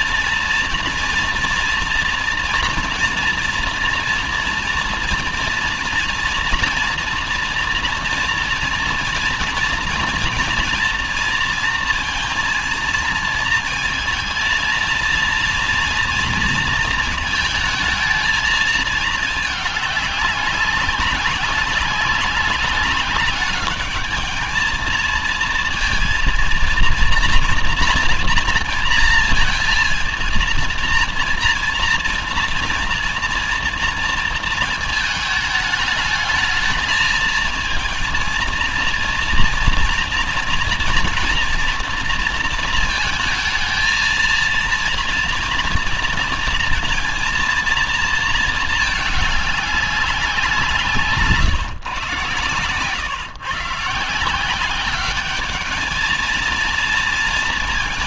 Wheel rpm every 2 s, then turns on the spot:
230, 230, 230, 230, 230, 230, 230, 230, 230, 220, 200, 200, 220, 230, 230, 230, 230, 220, 220, 230, 230, 230, 230, 230, 220, 160, 130, 200, 220.
none